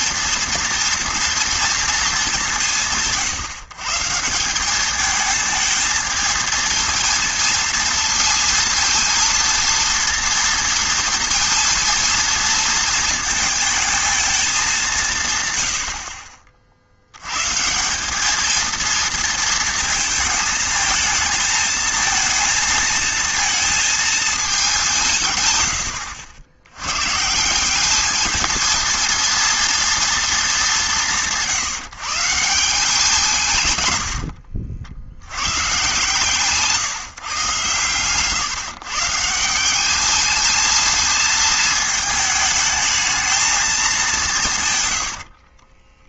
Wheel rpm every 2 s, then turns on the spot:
230, 170, 200, 230, 230, 230, 230, 200, 50, 220, 220, 230, 200, 100, 230, 210, 170, 70, 150, 140, 220, 220, 140.
none